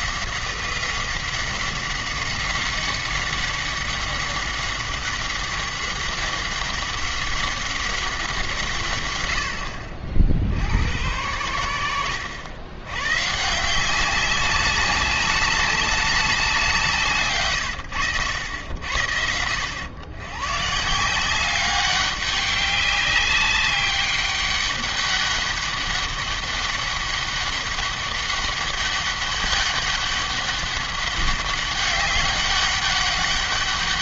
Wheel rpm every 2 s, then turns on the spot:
190, 190, 190, 190, 130, 90, 110, 200, 170, 80, 140, 200, 200, 200, 200, 200, 200.
none